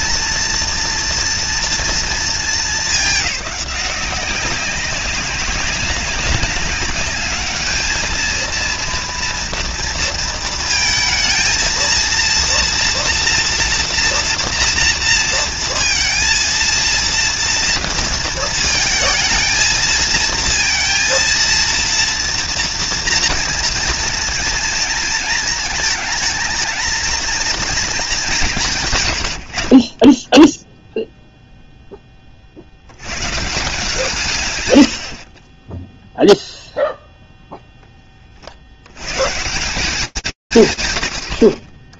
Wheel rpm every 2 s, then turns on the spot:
230, 230, 200, 200, 210, 230, 230, 240, 230, 230, 220, 230, 230, 220, 230, 80, 0, 140, 40, 0, 180.
none